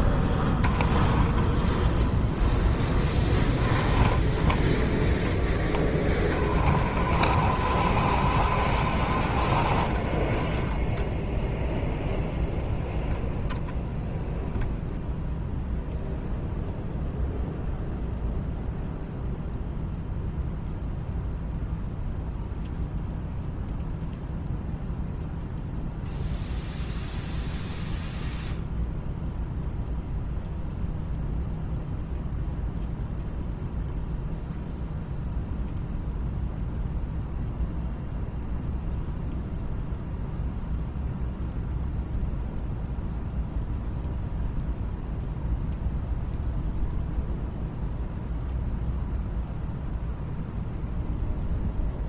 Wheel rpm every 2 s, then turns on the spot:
10, 10, 10, 50, 50, 10, 0, 0, 0, 0, 0, 0, 0, 0, 0, 0, 0, 0, 0, 0, 0, 0, 0, 0, 0, 0.
none